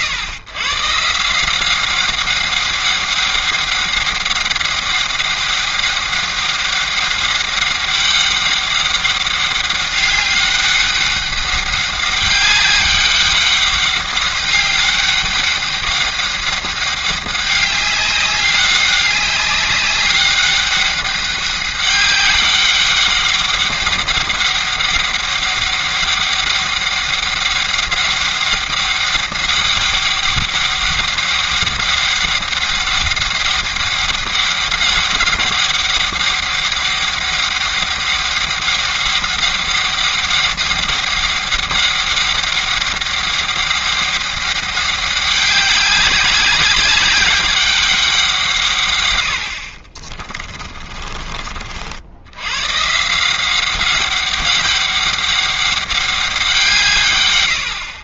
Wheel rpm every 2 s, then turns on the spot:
130, 200, 200, 200, 200, 200, 200, 200, 200, 200, 200, 200, 200, 200, 200, 200, 200, 200, 200, 200, 200, 200, 200, 200, 140, 40, 120, 200, 170.
50-52